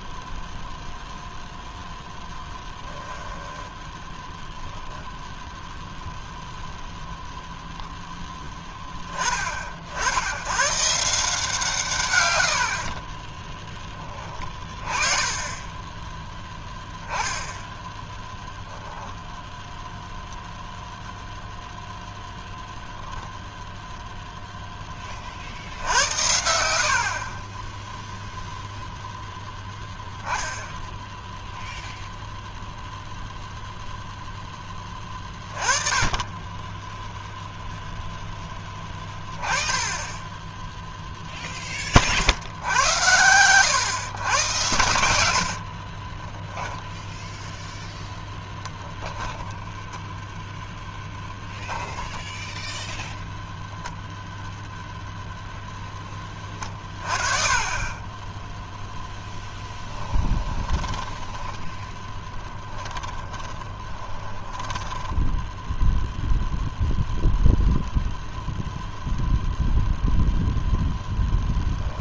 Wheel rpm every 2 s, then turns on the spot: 0, 10, 10, 0, 10, 140, 60, 20, 10, 0, 0, 0, 10, 60, 0, 10, 0, 20, 10, 10, 0, 90, 80, 10, 10, 10, 0, 0, 30, 0, 20, 20, 10, 0, 0, 0.
2-4 44-48 60-66